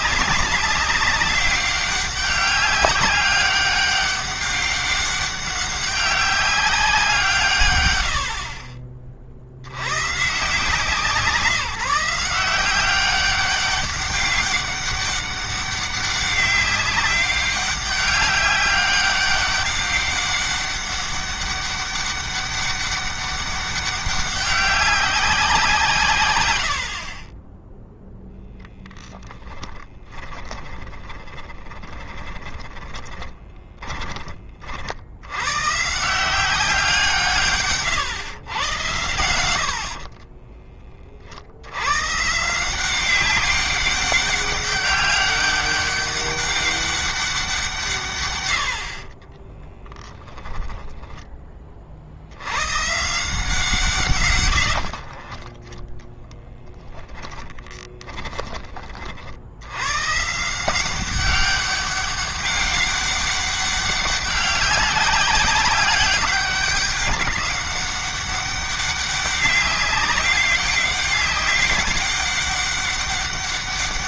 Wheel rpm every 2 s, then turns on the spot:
200, 200, 200, 190, 50, 160, 190, 200, 200, 200, 200, 200, 200, 70, 0, 10, 20, 70, 170, 110, 30, 180, 200, 200, 70, 10, 130, 60, 30, 30, 170, 200, 190, 190, 200, 200, 200.
30-34 48-50 54-58